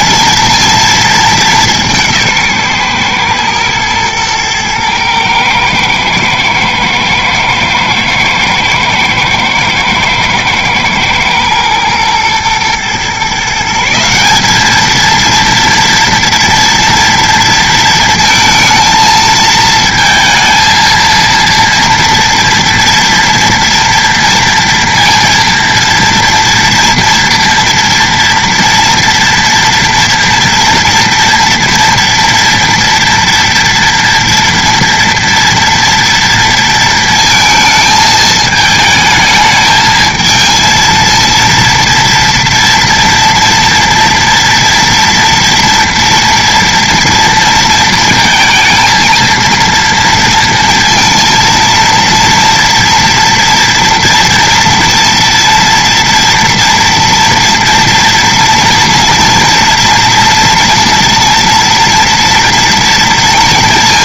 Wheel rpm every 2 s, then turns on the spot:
230, 140, 110, 110, 120, 110, 120, 220, 230, 230, 230, 230, 230, 230, 230, 230, 230, 230, 230, 220, 230, 230, 240, 230, 230, 230, 230, 230, 230, 230, 230, 230.
none